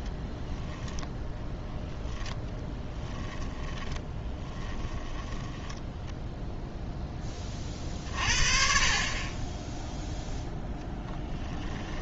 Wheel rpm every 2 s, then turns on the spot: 0, 10, 10, 0, 40, 0.
2-6